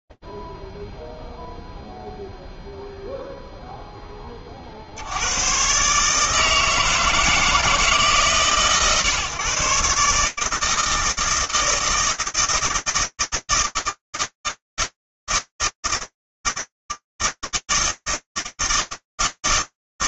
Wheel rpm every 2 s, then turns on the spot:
0, 0, 10, 150, 150, 150, 160, 160, 160, 160.
none